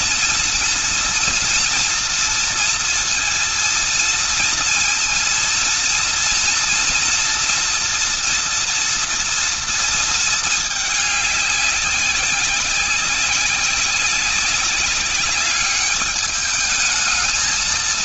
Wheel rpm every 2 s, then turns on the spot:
230, 230, 230, 230, 230, 210, 190, 200, 220.
none